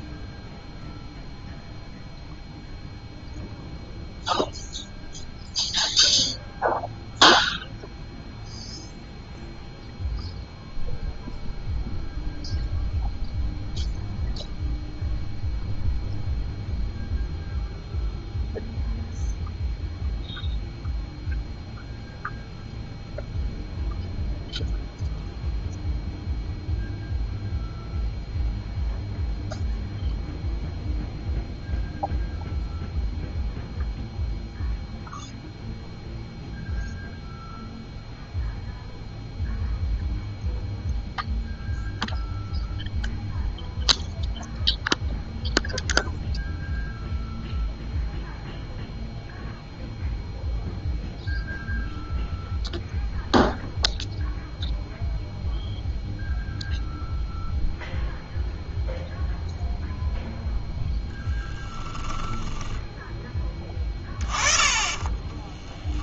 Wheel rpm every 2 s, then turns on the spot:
0, 0, 0, 0, 0, 0, 0, 0, 0, 0, 0, 0, 0, 0, 0, 0, 0, 0, 0, 0, 0, 0, 0, 0, 0, 0, 0, 0, 0, 0, 0, 10, 20.
62-66